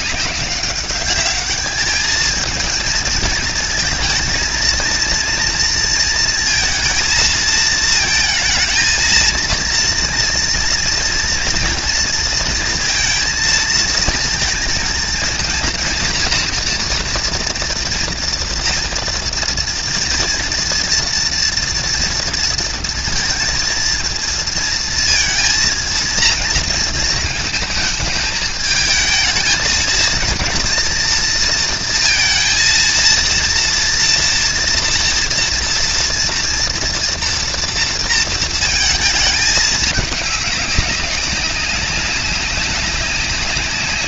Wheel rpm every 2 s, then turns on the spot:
200, 220, 230, 230, 230, 230, 230, 230, 230, 240, 230, 230, 230, 220, 220, 230, 230, 230, 230, 220, 200, 200.
none